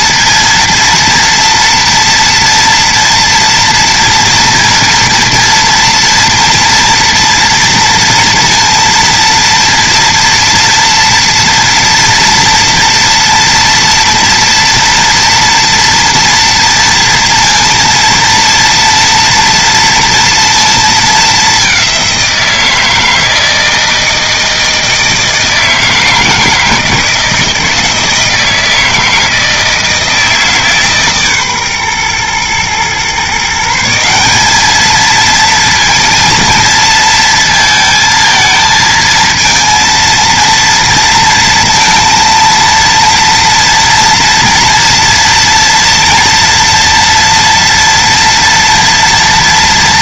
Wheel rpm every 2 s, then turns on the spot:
230, 230, 230, 230, 230, 240, 240, 230, 230, 230, 220, 160, 160, 160, 160, 150, 130, 220, 230, 220, 230, 230, 230, 230, 230.
none